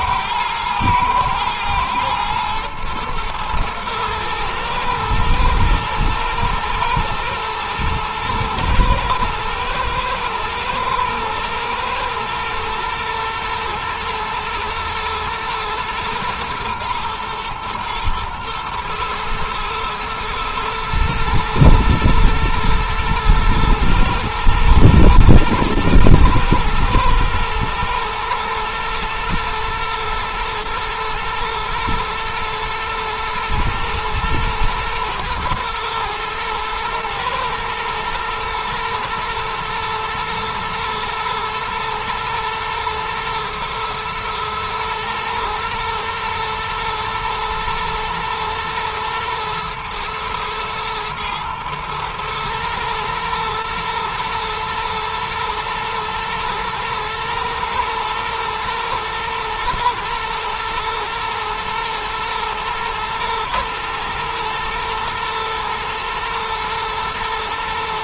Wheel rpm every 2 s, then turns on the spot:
120, 120, 110, 120, 110, 110, 110, 110, 120, 110, 120, 110, 120, 120, 110, 120, 120, 110, 110, 120, 120, 120, 110, 110, 110, 110, 110, 120, 110, 120, 110, 110, 120, 110.
none